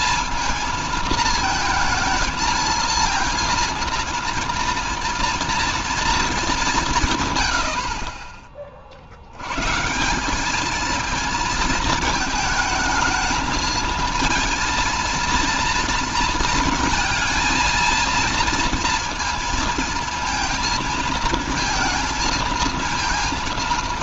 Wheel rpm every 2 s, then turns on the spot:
220, 230, 230, 190, 50, 220, 220, 230, 230, 230, 220, 230.
none